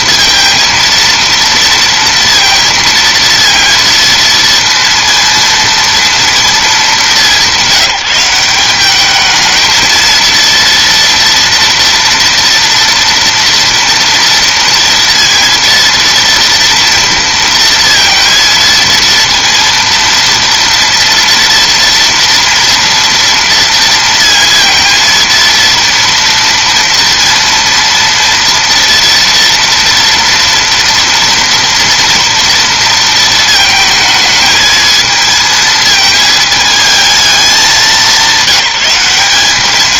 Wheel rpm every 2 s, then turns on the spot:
230, 230, 230, 220, 200, 230, 230, 230, 230, 230, 230, 230, 230, 230, 230, 230, 230, 220, 220, 200.
none